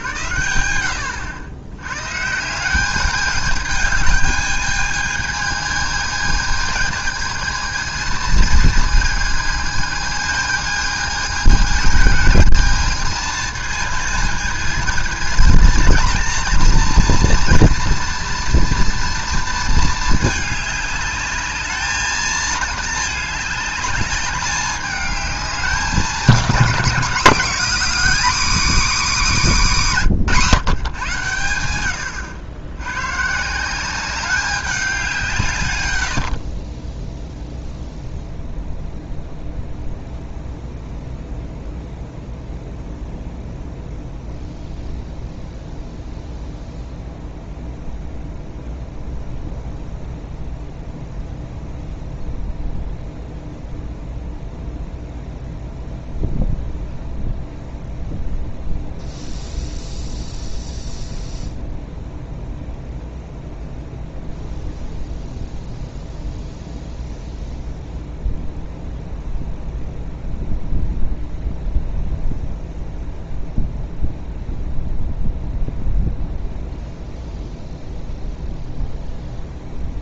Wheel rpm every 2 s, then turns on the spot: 100, 210, 220, 220, 220, 220, 220, 230, 240, 230, 210, 210, 200, 230, 270, 120, 140, 170, 0, 0, 0, 0, 0, 0, 0, 0, 0, 0, 0, 0, 0, 0, 0, 0, 0, 0, 0, 0, 0, 0.
none